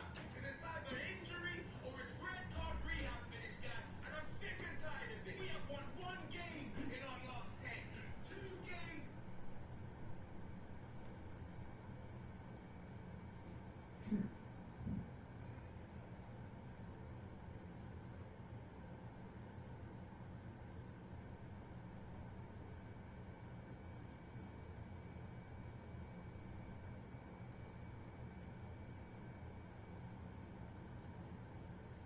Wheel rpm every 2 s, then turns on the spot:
0, 0, 0, 0, 0, 0, 0, 0, 0, 0, 0, 0, 0, 0, 0, 0.
none